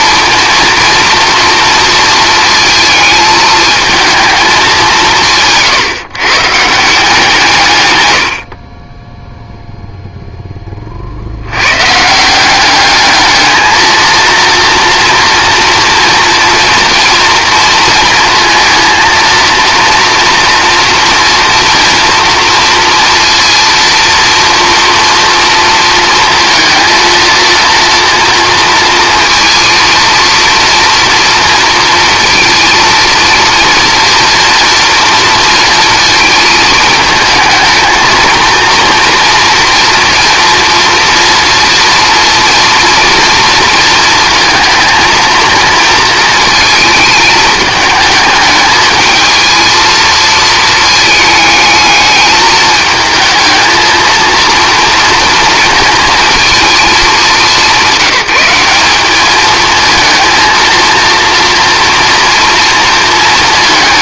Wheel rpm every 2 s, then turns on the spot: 230, 220, 200, 160, 30, 30, 200, 230, 240, 230, 230, 230, 240, 230, 230, 240, 230, 230, 220, 230, 240, 230, 230, 220, 220, 220, 220, 230, 220, 190, 230, 230.
none